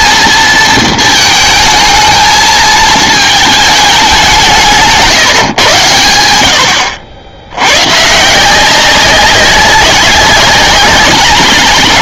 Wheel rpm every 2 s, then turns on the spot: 230, 220, 170, 100, 170, 190.
none